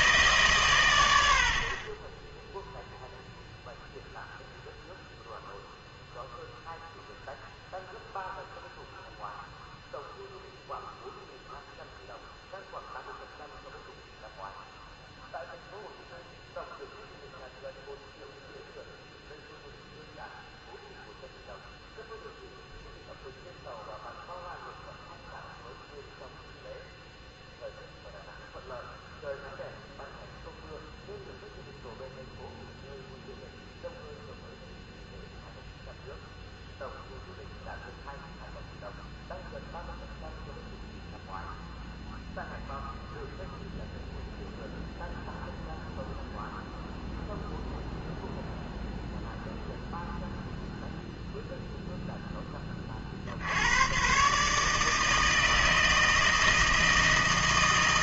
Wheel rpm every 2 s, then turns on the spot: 130, 0, 0, 0, 0, 0, 0, 0, 0, 0, 0, 0, 0, 0, 0, 0, 0, 0, 0, 0, 0, 0, 0, 0, 0, 0, 20, 150, 160.
none